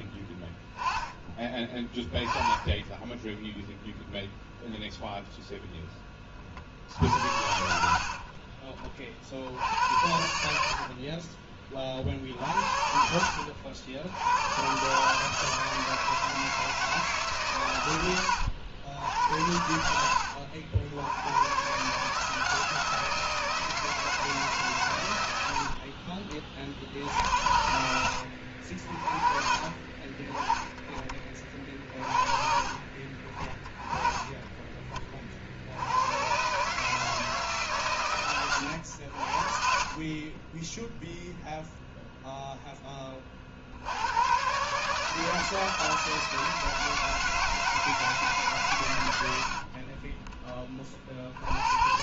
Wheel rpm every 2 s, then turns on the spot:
10, 20, 0, 50, 50, 60, 60, 110, 160, 90, 80, 160, 140, 50, 60, 20, 40, 20, 140, 100, 10, 10, 140, 170, 130, 20.
none